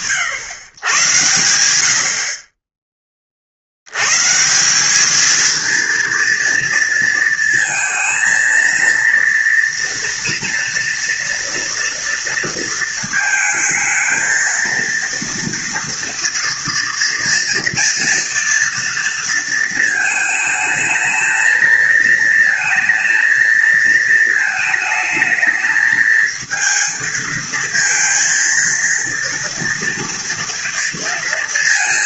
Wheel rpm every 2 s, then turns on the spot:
120, 30, 200, 230, 230, 230, 230, 230, 230, 230, 220, 230, 220, 230, 230, 230.
none